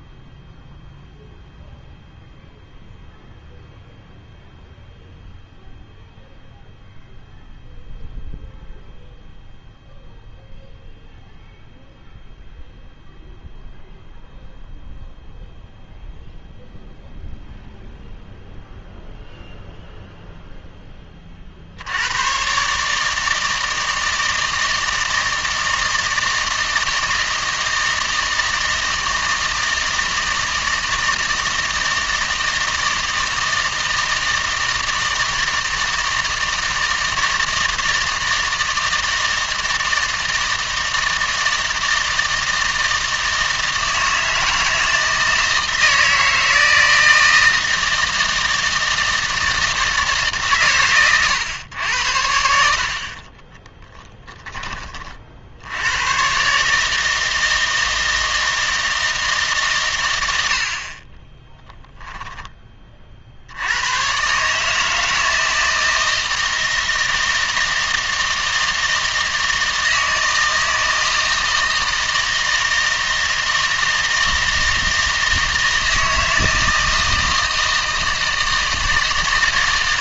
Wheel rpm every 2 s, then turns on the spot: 0, 0, 0, 0, 0, 0, 0, 0, 0, 0, 10, 140, 160, 160, 160, 160, 160, 160, 160, 160, 160, 160, 160, 160, 160, 120, 60, 20, 150, 160, 50, 30, 150, 160, 160, 160, 160, 160, 160, 160.
none